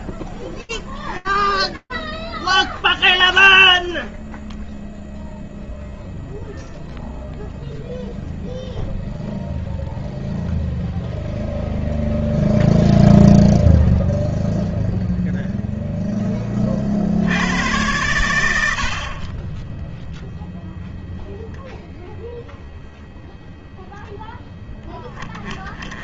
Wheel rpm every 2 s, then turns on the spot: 0, 0, 0, 0, 0, 0, 0, 20, 50, 0, 0, 20, 0.
none